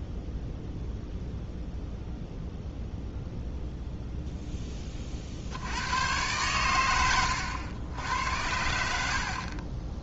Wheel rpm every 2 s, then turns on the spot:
0, 0, 10, 110, 80.
none